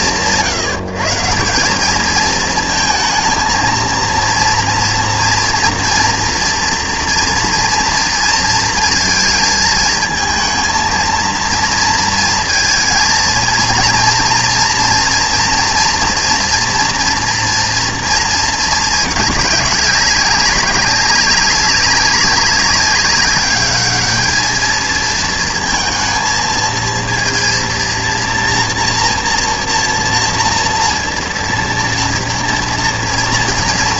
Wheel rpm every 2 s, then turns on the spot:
150, 230, 240, 230, 220, 230, 230, 230, 230, 210, 200, 200, 230, 230, 240, 230, 230.
none